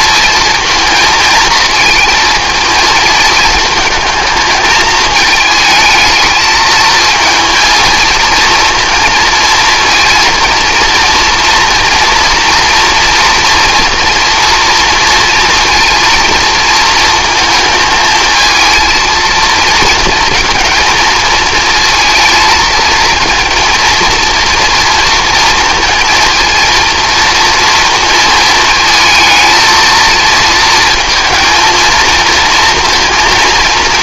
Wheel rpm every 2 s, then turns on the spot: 230, 220, 220, 220, 230, 230, 230, 230, 230, 220, 220, 230, 240, 230, 220, 230, 230.
none